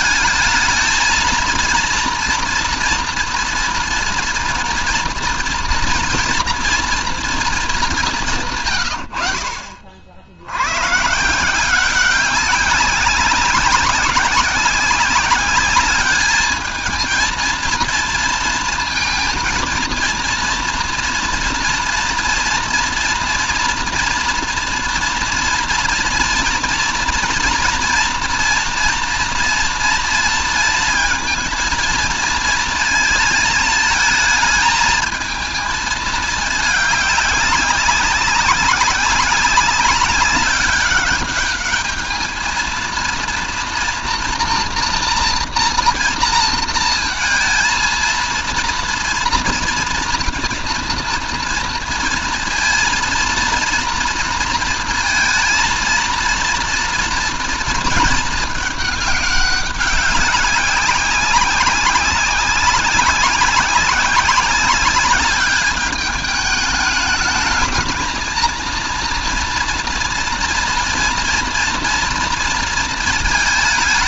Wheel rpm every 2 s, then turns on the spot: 220, 230, 230, 230, 90, 140, 190, 200, 220, 220, 230, 240, 230, 230, 230, 230, 230, 220, 200, 190, 200, 230, 230, 230, 230, 230, 230, 230, 230, 210, 190, 200, 200, 210, 230, 230, 230.
none